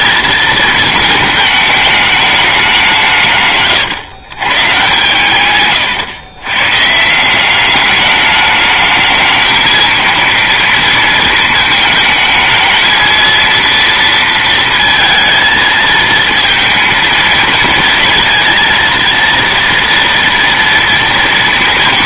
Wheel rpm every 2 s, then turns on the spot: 220, 190, 130, 130, 210, 230, 220, 230, 220, 230, 230.
none